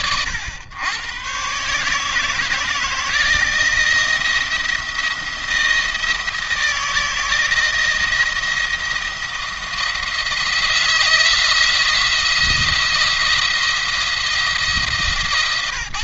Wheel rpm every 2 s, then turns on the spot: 100, 160, 170, 160, 170, 170, 170, 160.
none